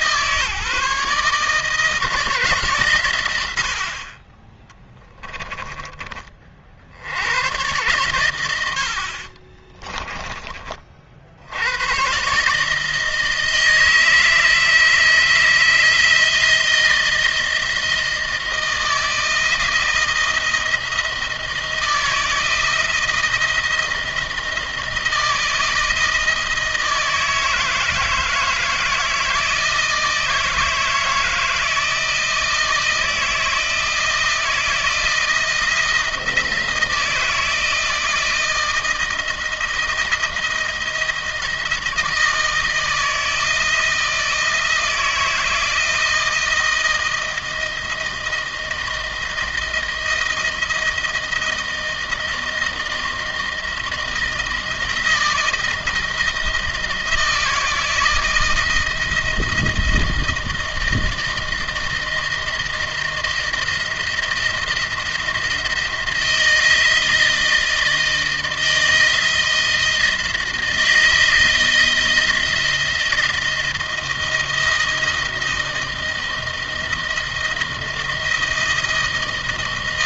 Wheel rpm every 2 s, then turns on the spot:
150, 130, 10, 70, 70, 40, 160, 160, 160, 160, 160, 160, 170, 160, 160, 160, 160, 160, 160, 170, 170, 160, 160, 160, 160, 160, 160, 170, 170, 160, 160, 160, 160, 160, 160, 160, 160, 160, 160, 160.
4-6 8-10